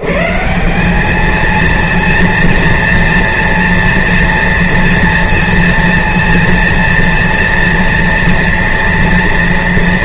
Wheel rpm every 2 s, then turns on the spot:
90, 230, 230, 230, 230.
none